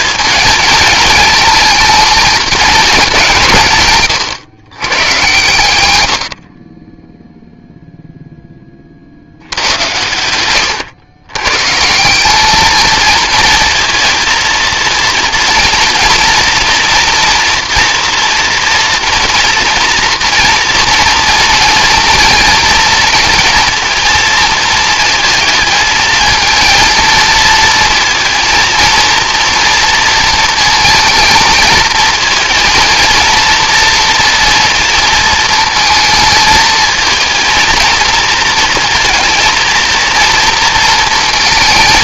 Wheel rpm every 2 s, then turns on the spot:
220, 220, 120, 60, 40, 110, 220, 230, 230, 230, 230, 230, 220, 220, 230, 230, 230, 230, 220, 230, 230.
none